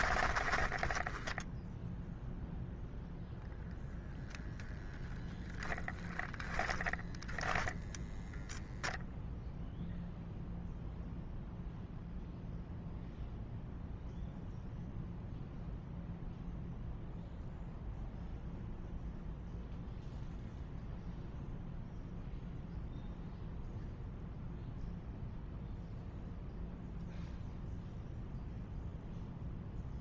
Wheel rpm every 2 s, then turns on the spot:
10, 0, 20, 20, 0, 0, 0, 0, 0, 0, 0, 0, 0, 0, 0.
0-2 6-8